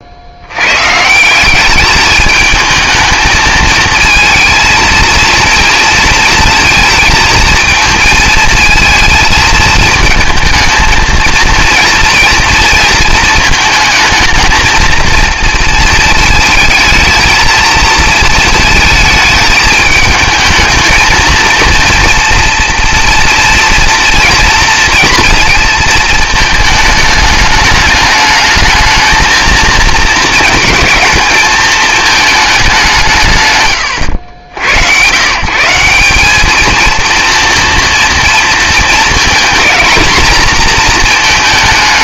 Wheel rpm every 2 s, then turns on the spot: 110, 220, 230, 230, 220, 220, 230, 220, 220, 220, 220, 230, 230, 220, 220, 220, 190, 90, 220, 230, 230.
none